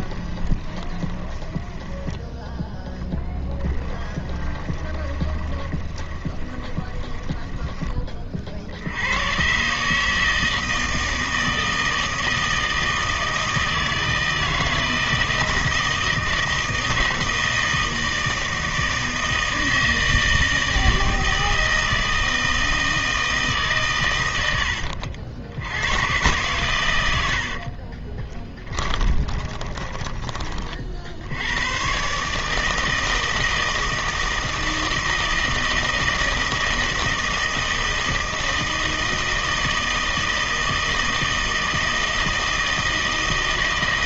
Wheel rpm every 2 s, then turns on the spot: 20, 10, 20, 20, 70, 160, 160, 160, 160, 160, 160, 160, 80, 110, 10, 40, 160, 160, 160, 160, 160, 160.
0-2 4-8 28-30